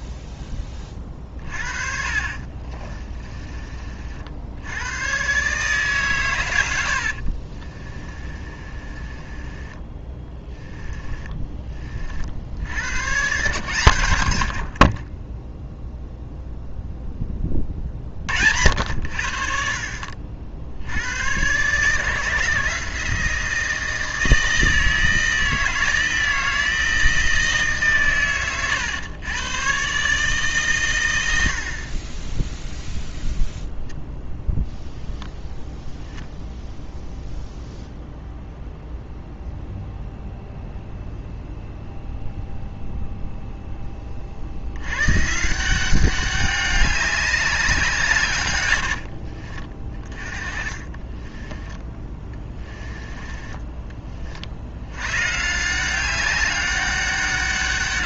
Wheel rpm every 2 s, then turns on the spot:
20, 40, 90, 80, 30, 10, 80, 60, 0, 70, 60, 160, 160, 160, 130, 130, 0, 0, 0, 0, 0, 0, 90, 200, 90, 30, 20, 80, 200.
2-4 6-12 14-16 50-54